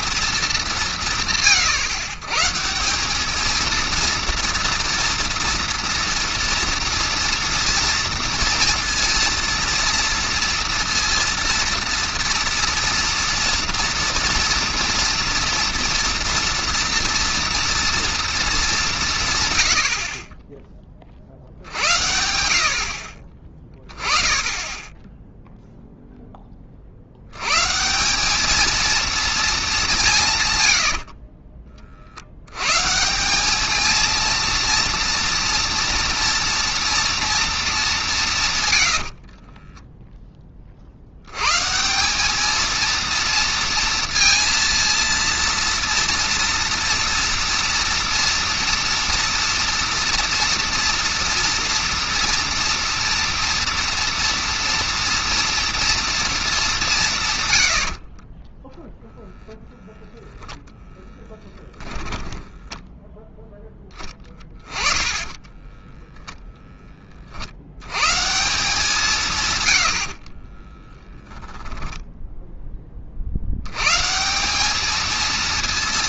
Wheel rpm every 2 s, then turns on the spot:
140, 210, 230, 230, 230, 230, 230, 230, 230, 140, 20, 50, 20, 20, 220, 100, 100, 230, 230, 130, 20, 210, 230, 230, 230, 230, 240, 230, 230, 20, 0, 10, 10, 0, 160, 40, 0, 180.
38-40 58-60 62-66 70-72